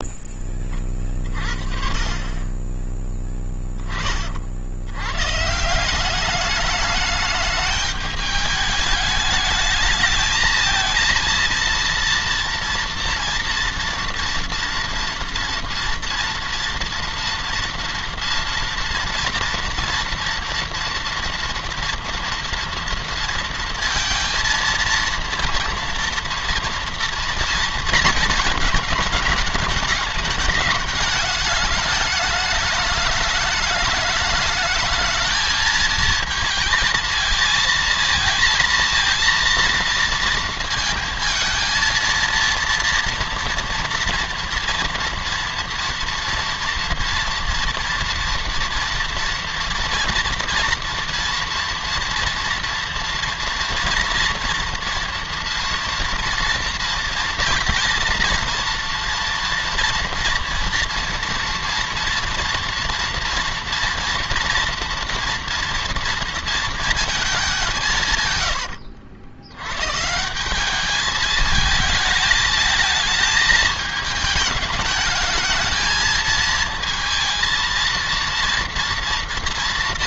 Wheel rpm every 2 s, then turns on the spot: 10, 30, 60, 200, 210, 220, 230, 230, 230, 230, 230, 230, 230, 230, 220, 210, 210, 210, 220, 230, 230, 230, 230, 230, 230, 230, 240, 240, 230, 230, 230, 230, 230, 230, 110, 170, 220, 220, 220, 230.
68-70